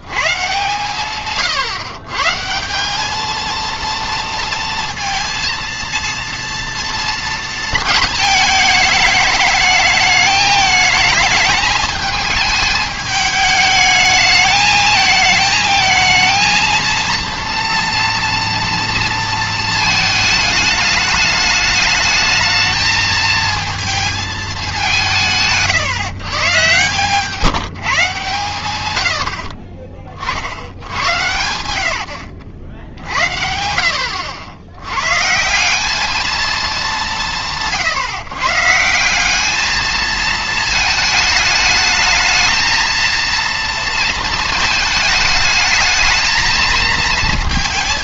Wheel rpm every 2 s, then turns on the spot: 130, 160, 230, 230, 220, 210, 220, 220, 230, 230, 210, 220, 200, 130, 120, 80, 70, 80, 220, 150, 220, 220, 220, 220.
none